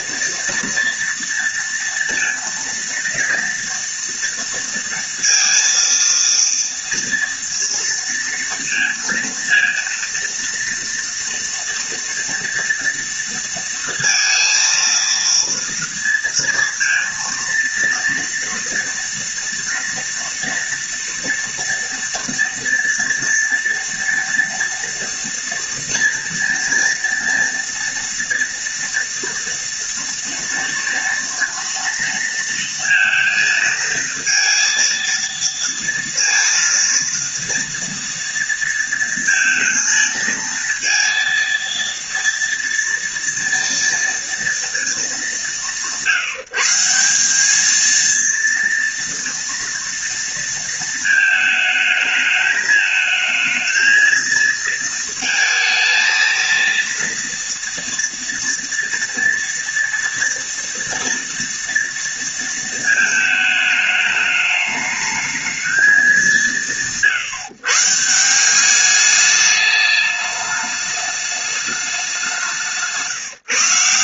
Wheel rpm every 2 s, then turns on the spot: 230, 230, 230, 230, 230, 230, 230, 230, 230, 230, 230, 230, 230, 230, 230, 230, 230, 230, 230, 230, 230, 230, 200, 170, 230, 230, 220, 230, 230, 230, 230, 220, 210, 170, 190, 210, 170.
none